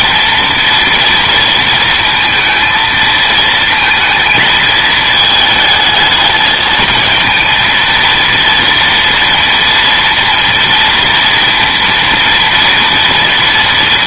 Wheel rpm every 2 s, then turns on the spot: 230, 230, 220, 220, 230, 230, 240.
none